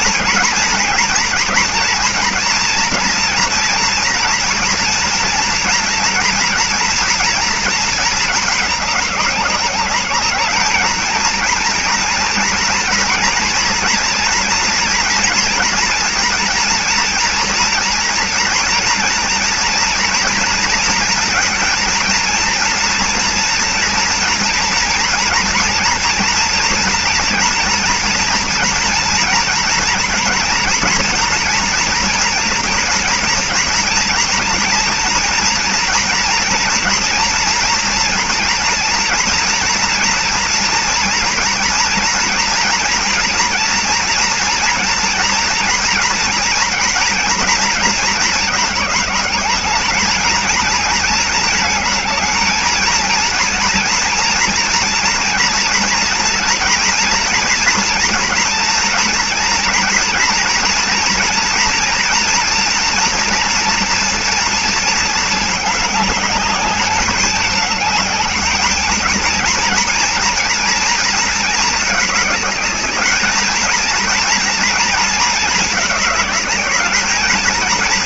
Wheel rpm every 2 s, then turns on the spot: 230, 230, 230, 230, 210, 210, 230, 230, 240, 240, 230, 230, 230, 230, 230, 230, 230, 230, 230, 230, 240, 230, 230, 230, 220, 220, 220, 240, 230, 240, 230, 230, 230, 210, 220, 230, 220, 230, 220.
none